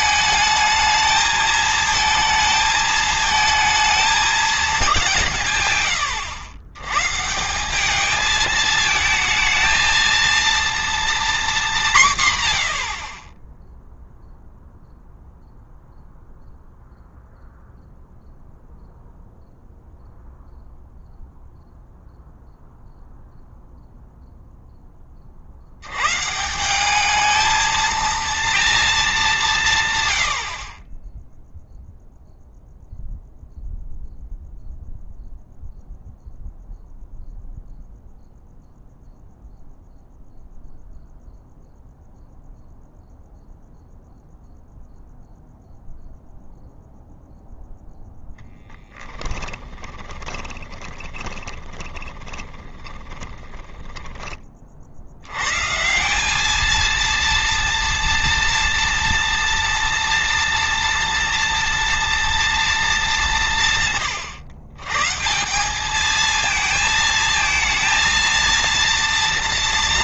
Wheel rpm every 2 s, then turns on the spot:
220, 220, 190, 120, 220, 240, 70, 0, 0, 0, 0, 0, 20, 200, 220, 20, 0, 0, 0, 0, 0, 0, 0, 0, 10, 20, 10, 50, 220, 230, 230, 220, 130, 220, 230.
50-54